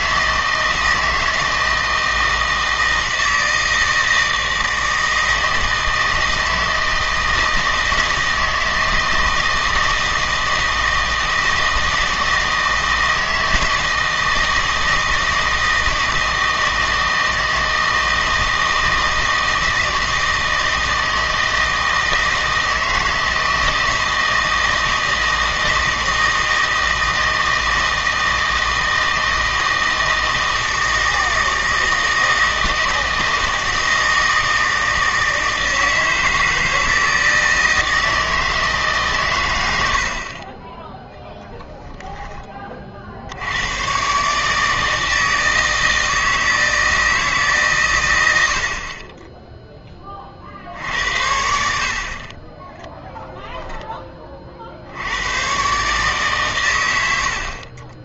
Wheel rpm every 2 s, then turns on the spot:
160, 160, 160, 160, 160, 160, 160, 160, 160, 160, 160, 160, 160, 160, 160, 160, 160, 160, 160, 150, 10, 30, 150, 160, 60, 70, 10, 60, 120.
none